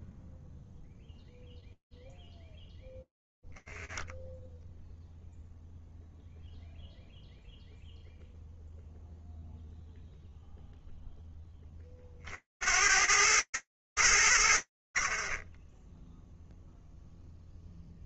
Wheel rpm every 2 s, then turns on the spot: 0, 0, 0, 0, 0, 40, 110, 20, 0.
none